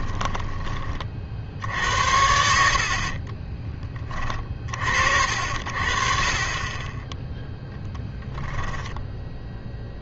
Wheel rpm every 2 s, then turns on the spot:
30, 60, 40, 20, 0.
2-4